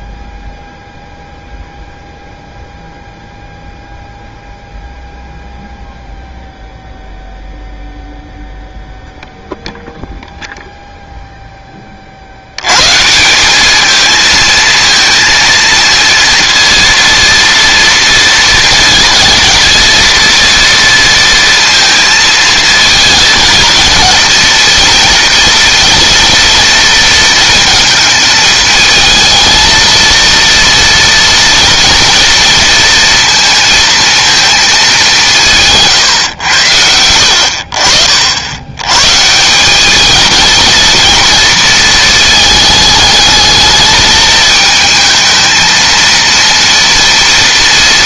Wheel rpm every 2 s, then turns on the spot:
0, 0, 0, 0, 0, 0, 120, 230, 230, 230, 230, 220, 230, 230, 220, 230, 230, 210, 80, 110, 230, 220, 220, 230.
none